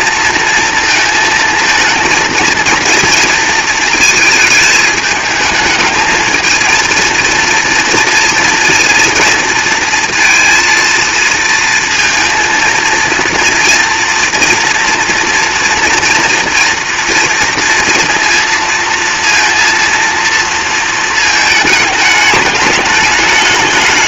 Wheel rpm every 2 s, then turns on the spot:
230, 230, 220, 230, 230, 230, 230, 230, 230, 230, 230, 210.
none